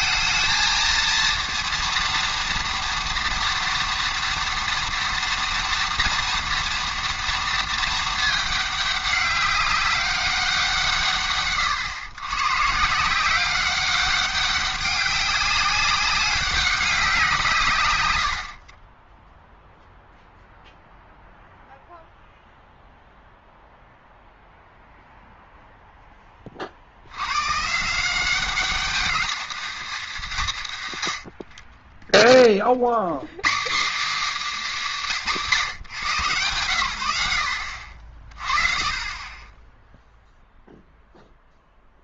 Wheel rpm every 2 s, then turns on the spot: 230, 230, 240, 230, 210, 170, 130, 190, 190, 50, 0, 0, 0, 50, 200, 160, 50, 250, 110, 30, 0.
none